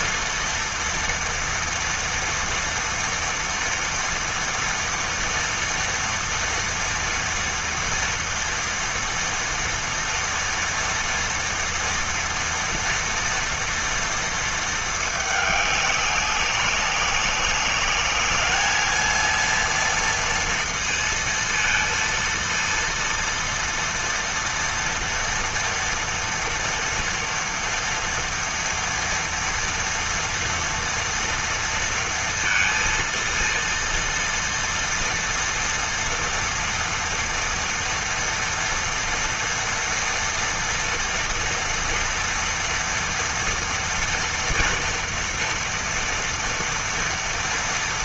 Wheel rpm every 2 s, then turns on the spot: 230, 230, 230, 230, 230, 230, 230, 210, 190, 220, 230, 230, 240, 230, 230, 230, 230, 230, 230, 240, 230, 230, 230, 240.
none